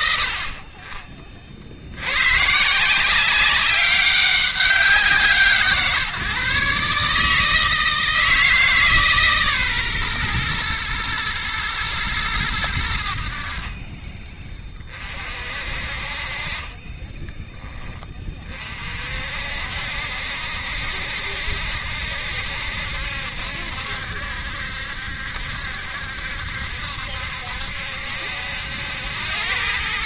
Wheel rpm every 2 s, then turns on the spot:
50, 150, 190, 150, 150, 120, 90, 30, 30, 40, 60, 70, 70, 70, 80.
16-18